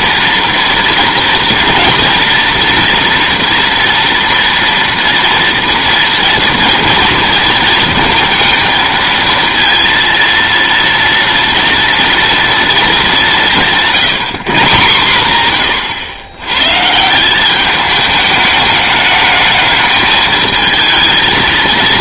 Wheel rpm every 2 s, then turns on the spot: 230, 230, 230, 230, 230, 230, 230, 150, 130, 210, 220.
none